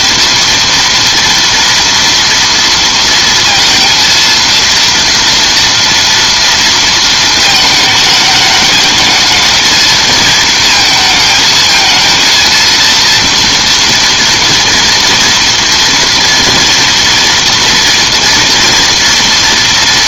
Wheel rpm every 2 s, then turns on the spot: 230, 230, 230, 230, 220, 230, 230, 230, 230, 230.
none